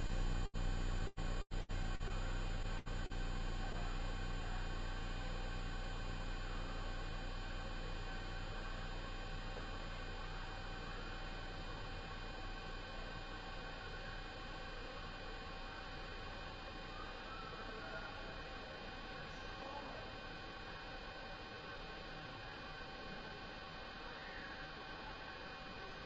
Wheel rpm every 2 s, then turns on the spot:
0, 0, 0, 0, 0, 0, 0, 0, 0, 0, 0, 0, 0.
none